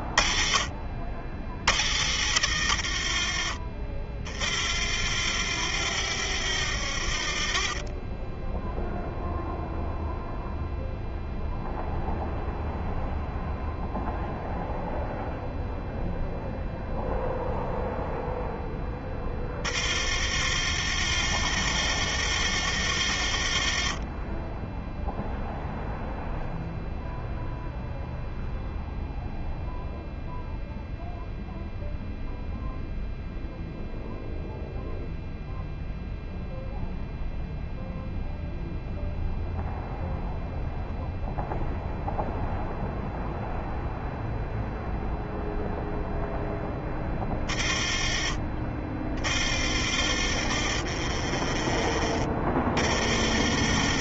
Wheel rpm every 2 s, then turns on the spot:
30, 60, 30, 40, 10, 0, 0, 0, 0, 0, 40, 50, 20, 0, 0, 0, 0, 0, 0, 0, 0, 0, 0, 0, 20, 30, 20.
none